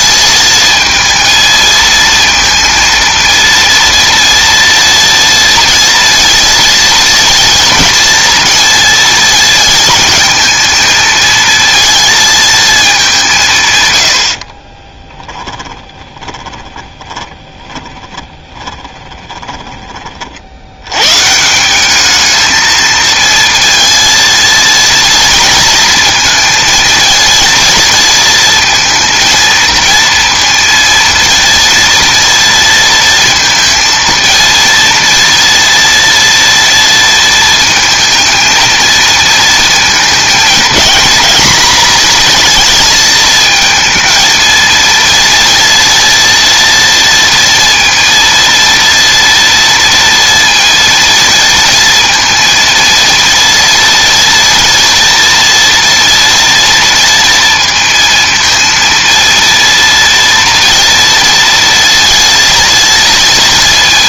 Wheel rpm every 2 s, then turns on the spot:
220, 230, 230, 230, 230, 220, 220, 30, 20, 30, 90, 220, 230, 230, 230, 230, 230, 230, 230, 230, 230, 230, 230, 230, 230, 230, 230, 230, 230, 230, 230, 230.
14-20